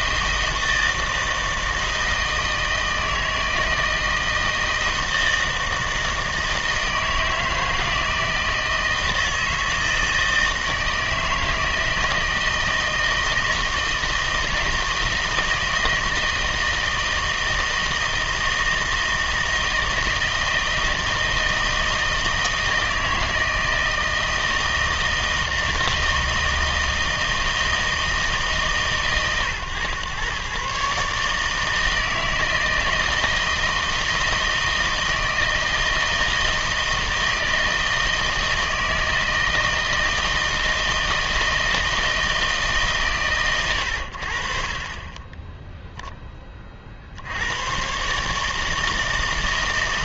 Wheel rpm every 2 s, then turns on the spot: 160, 160, 160, 160, 160, 160, 160, 160, 160, 160, 160, 160, 160, 160, 130, 130, 160, 160, 160, 160, 160, 150, 40, 40, 160.
none